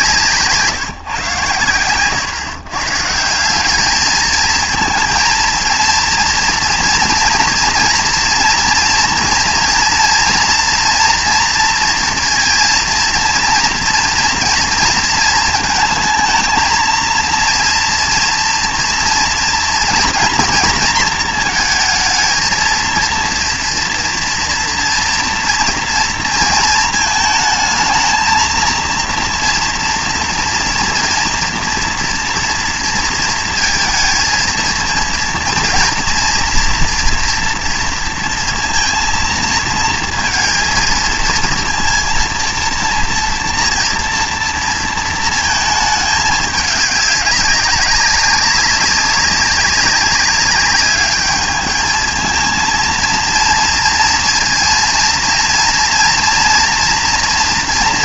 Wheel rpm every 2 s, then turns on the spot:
150, 130, 230, 230, 240, 230, 230, 230, 220, 230, 230, 230, 240, 220, 230, 230, 230, 230, 230, 230, 230, 230, 240, 210, 200, 200, 220, 230, 230.
none